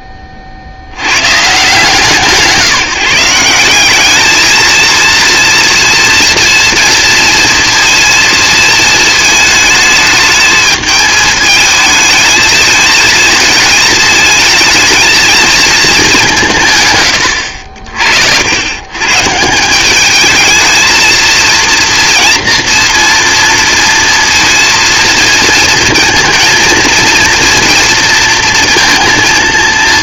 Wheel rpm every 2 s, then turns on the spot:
60, 160, 220, 240, 230, 220, 220, 220, 160, 80, 220, 240, 230, 230, 230.
none